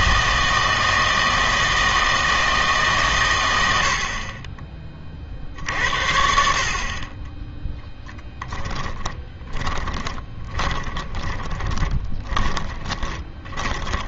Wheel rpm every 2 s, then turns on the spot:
160, 150, 20, 50, 20, 30, 20.
8-14